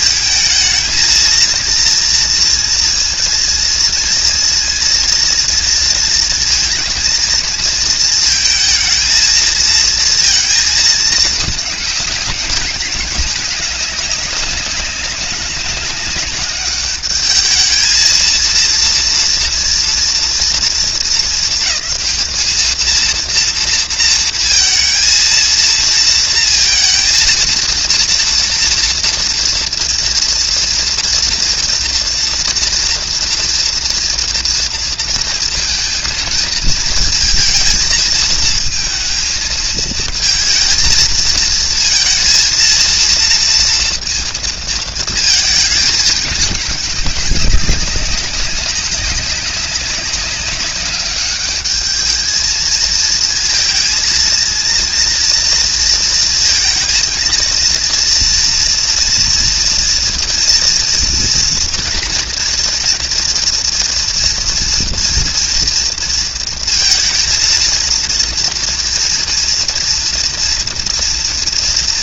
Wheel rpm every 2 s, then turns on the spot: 220, 230, 230, 230, 230, 220, 210, 200, 200, 230, 230, 220, 230, 230, 240, 230, 230, 230, 230, 230, 220, 230, 230, 210, 200, 200, 220, 230, 230, 230, 240, 230, 240, 230, 230, 230.
none